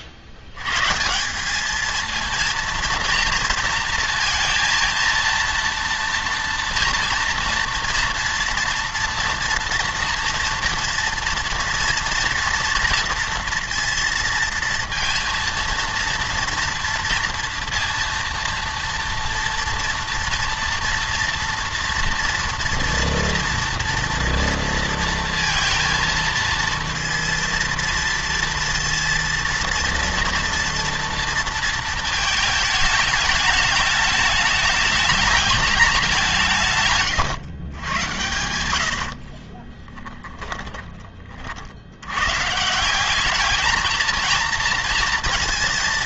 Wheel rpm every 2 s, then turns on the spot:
130, 230, 230, 230, 230, 230, 230, 230, 230, 230, 230, 230, 230, 230, 230, 230, 220, 210, 150, 90, 20, 160, 220.
36-38 40-42